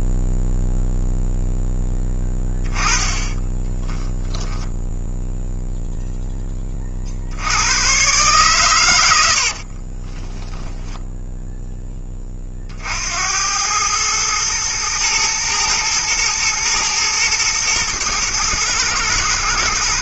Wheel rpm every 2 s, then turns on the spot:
0, 10, 10, 40, 120, 0, 60, 110, 110, 110.
none